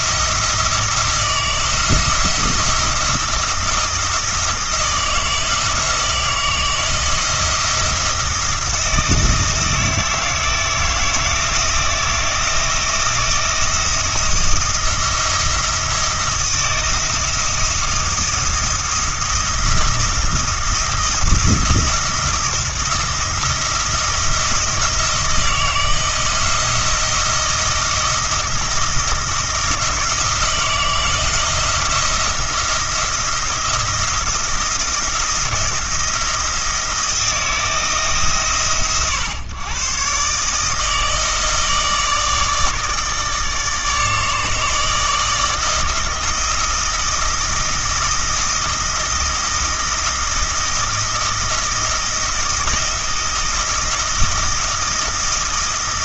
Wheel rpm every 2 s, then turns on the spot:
170, 170, 160, 170, 170, 160, 170, 170, 170, 170, 160, 170, 170, 170, 160, 160, 160, 170, 160, 130, 150, 160, 150, 160, 170, 170, 160, 160.
none